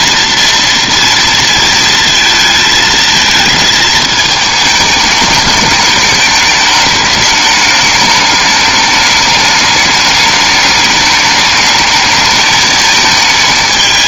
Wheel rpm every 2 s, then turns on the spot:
230, 230, 210, 210, 210, 210, 220.
none